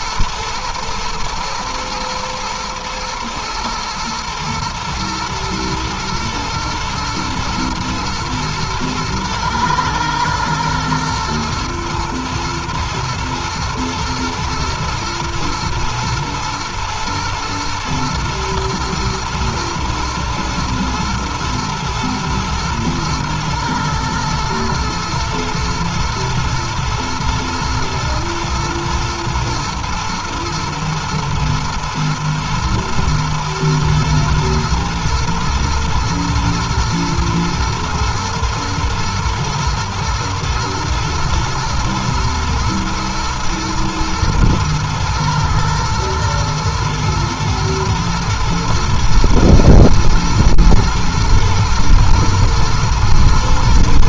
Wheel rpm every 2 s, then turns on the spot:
120, 120, 120, 120, 120, 120, 120, 120, 120, 110, 110, 120, 110, 120, 110, 120, 120, 110, 110, 120, 120, 110, 110, 110, 110, 120, 110.
none